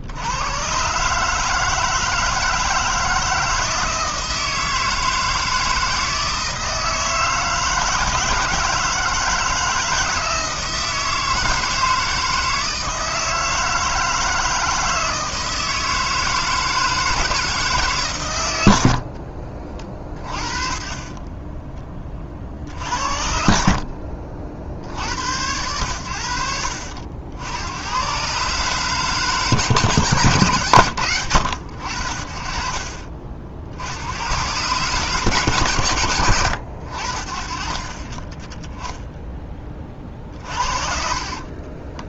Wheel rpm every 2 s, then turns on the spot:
130, 160, 160, 160, 160, 160, 160, 160, 160, 80, 40, 50, 60, 70, 140, 120, 50, 120, 70, 10, 40.
none